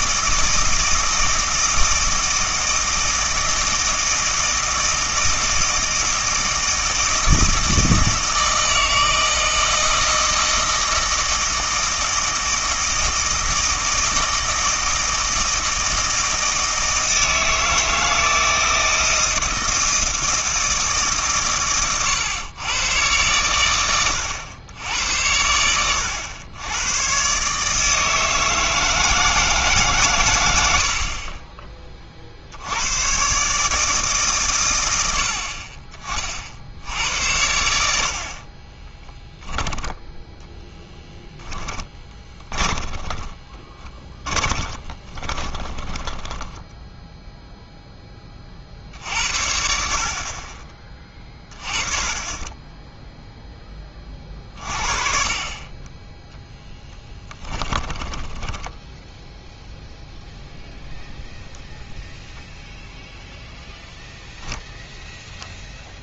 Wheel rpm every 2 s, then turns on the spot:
160, 160, 160, 160, 160, 160, 160, 160, 160, 160, 160, 110, 100, 100, 160, 70, 90, 110, 70, 20, 0, 10, 30, 20, 50, 30, 10, 40, 10, 10, 0, 0, 0.
38-40 42-48 56-60